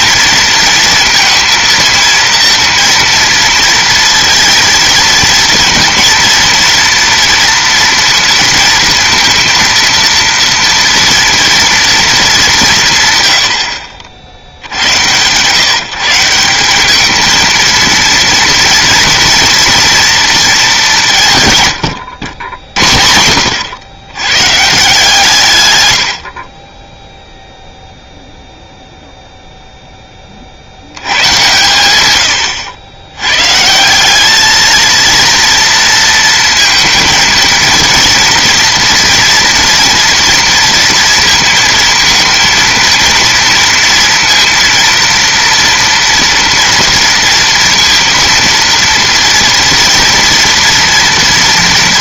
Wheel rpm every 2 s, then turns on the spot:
230, 230, 230, 230, 230, 230, 180, 80, 180, 230, 210, 80, 140, 20, 0, 60, 100, 220, 230, 230, 230, 230, 230, 230, 230, 240.
none